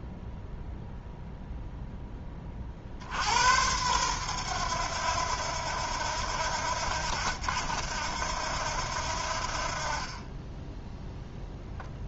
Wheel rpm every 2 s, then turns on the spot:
0, 50, 100, 80, 80, 10.
none